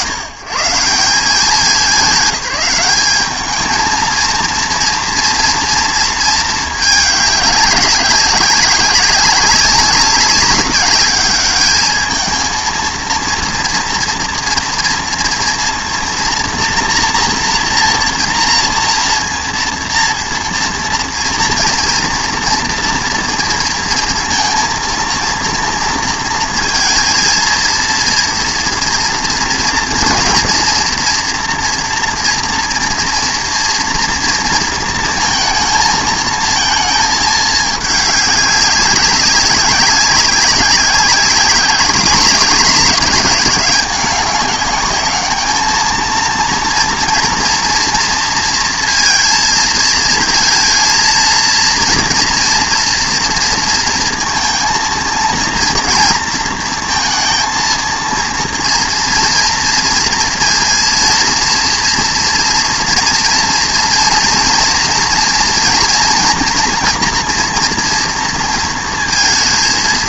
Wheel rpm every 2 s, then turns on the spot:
110, 200, 230, 210, 190, 200, 220, 230, 230, 230, 230, 230, 230, 230, 230, 230, 230, 230, 220, 190, 190, 200, 200, 230, 230, 230, 240, 230, 230, 230, 230, 230, 230, 240, 230.
none